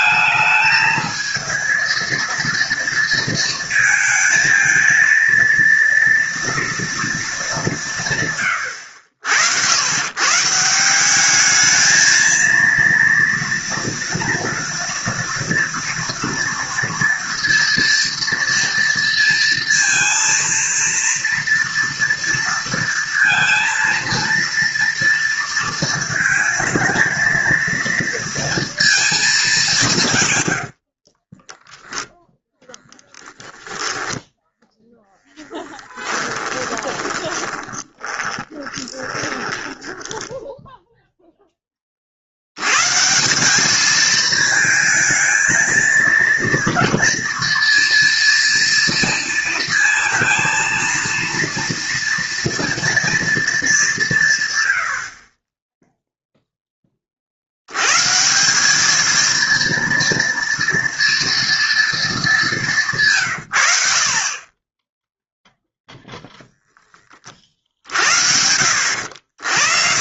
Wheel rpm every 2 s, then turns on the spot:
220, 230, 220, 230, 130, 120, 220, 230, 230, 230, 230, 230, 230, 230, 230, 130, 10, 10, 10, 20, 10, 60, 220, 230, 230, 230, 230, 160, 0, 150, 230, 220, 50, 0, 70.
34-42